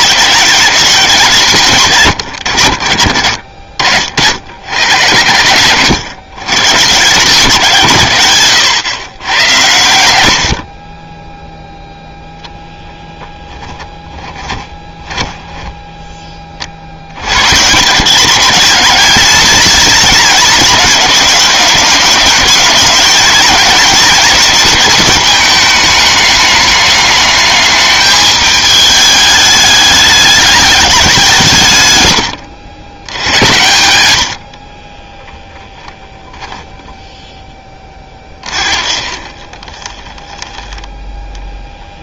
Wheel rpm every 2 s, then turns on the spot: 180, 80, 110, 140, 130, 60, 0, 10, 40, 200, 210, 210, 210, 200, 210, 210, 90, 50, 0, 30, 10.
14-16 34-36 38-42